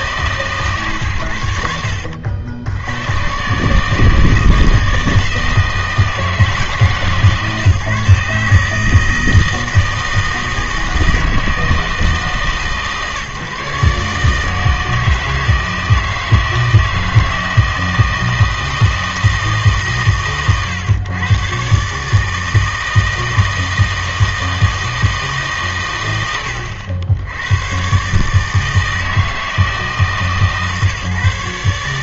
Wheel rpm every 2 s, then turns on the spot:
120, 80, 160, 160, 160, 160, 150, 160, 160, 160, 130, 160, 160, 90, 160, 140.
none